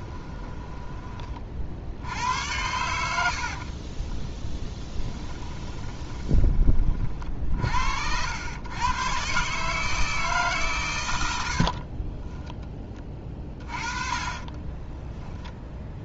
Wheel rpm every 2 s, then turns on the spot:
20, 100, 10, 30, 110, 130, 10, 20.
0-2 4-6 14-16